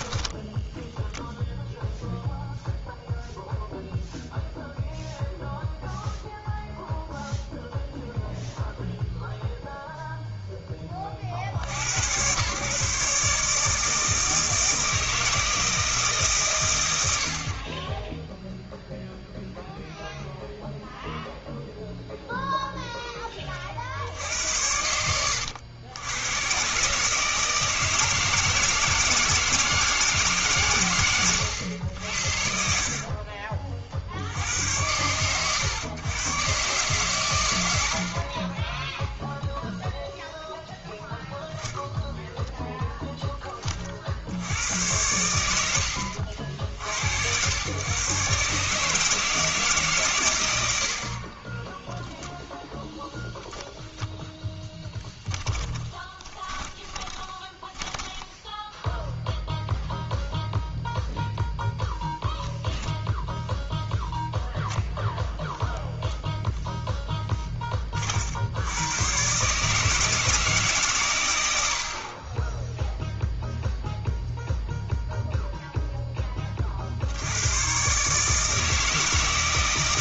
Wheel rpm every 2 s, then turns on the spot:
10, 0, 0, 0, 0, 20, 140, 160, 100, 0, 0, 10, 90, 140, 160, 120, 60, 90, 130, 0, 0, 0, 100, 80, 150, 70, 0, 0, 20, 0, 0, 10, 0, 0, 100, 140, 0, 0, 60, 160.
56-58